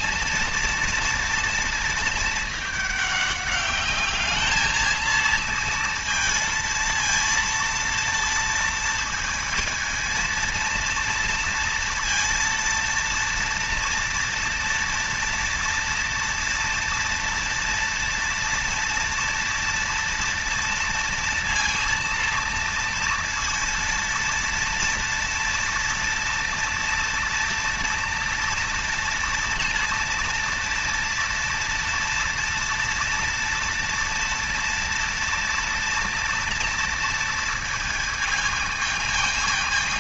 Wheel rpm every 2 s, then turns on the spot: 230, 220, 210, 230, 230, 230, 230, 230, 230, 230, 230, 230, 230, 230, 230, 230, 230, 230, 230, 220.
none